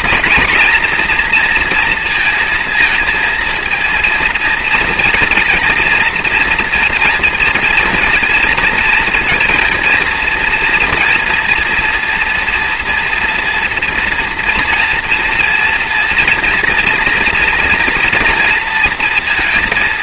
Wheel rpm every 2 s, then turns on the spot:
230, 230, 230, 230, 230, 230, 240, 240, 240, 230.
none